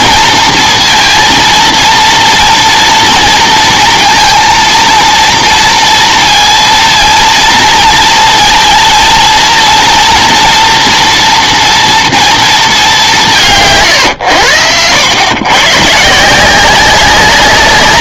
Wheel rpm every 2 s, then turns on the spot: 230, 230, 230, 230, 230, 230, 220, 90, 180.
none